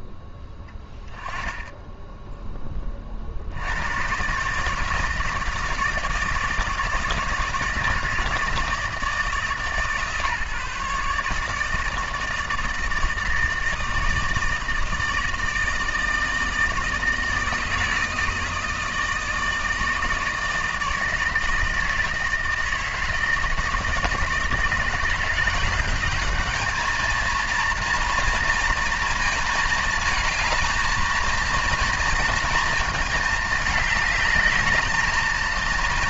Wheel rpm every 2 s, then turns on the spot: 10, 30, 160, 160, 160, 150, 160, 160, 160, 160, 160, 160, 160, 220, 230, 220, 220, 210.
none